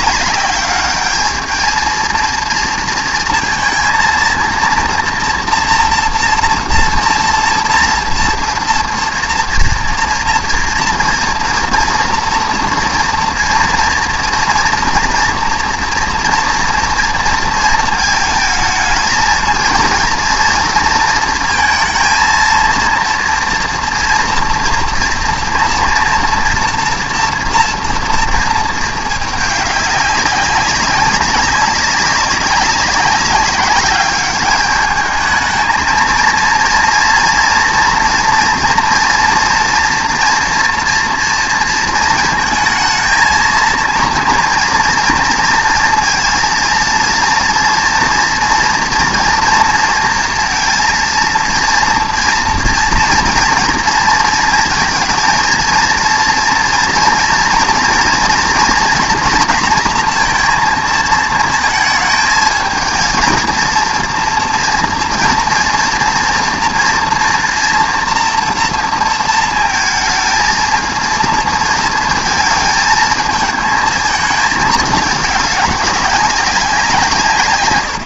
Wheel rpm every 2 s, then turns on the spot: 200, 230, 230, 230, 230, 230, 230, 240, 230, 220, 230, 230, 240, 240, 220, 200, 190, 210, 230, 230, 230, 230, 230, 230, 230, 230, 230, 220, 230, 240, 230, 220, 230, 230, 230, 220, 220, 220, 190.
none